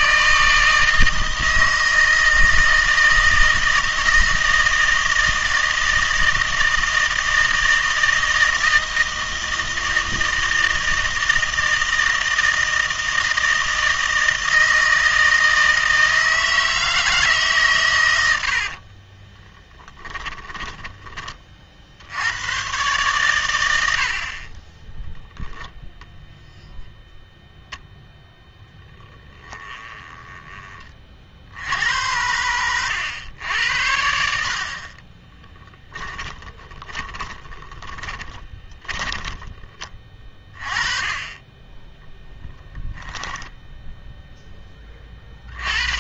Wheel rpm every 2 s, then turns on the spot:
160, 160, 160, 160, 160, 160, 160, 160, 160, 60, 10, 120, 20, 0, 0, 20, 90, 50, 20, 10, 20, 10, 20.
18-20 24-26 36-40 42-44